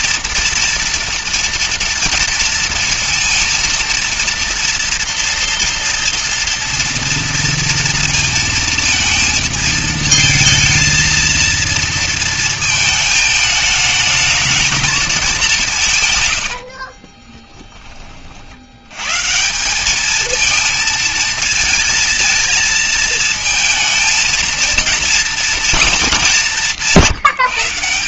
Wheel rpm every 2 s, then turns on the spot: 230, 230, 230, 230, 230, 220, 230, 220, 80, 70, 220, 230, 230, 200.
16-18